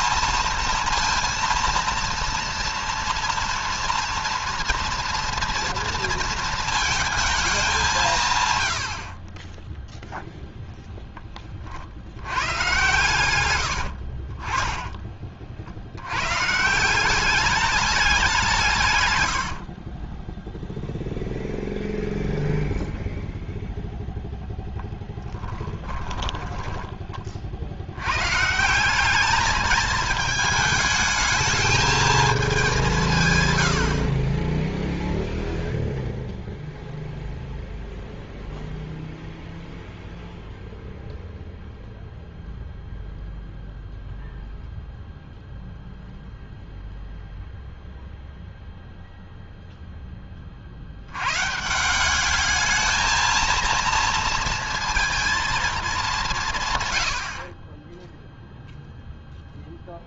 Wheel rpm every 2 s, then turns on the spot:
230, 230, 230, 220, 60, 0, 120, 30, 160, 120, 0, 0, 10, 20, 190, 220, 170, 0, 0, 0, 0, 0, 0, 0, 0, 80, 220, 230, 110, 0.
12-14 18-20 24-26